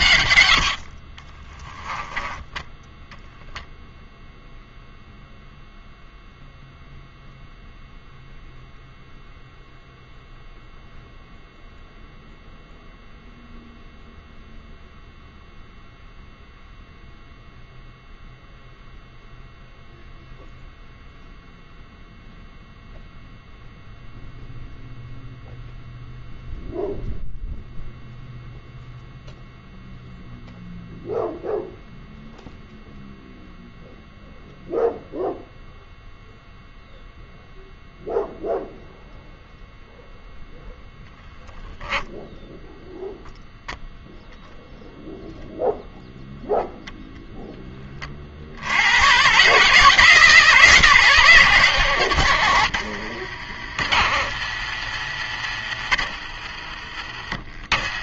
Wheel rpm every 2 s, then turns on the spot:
90, 10, 0, 0, 0, 0, 0, 0, 0, 0, 0, 0, 0, 0, 0, 0, 0, 0, 0, 0, 0, 0, 0, 0, 80, 160, 100, 110, 60.
0-2 52-54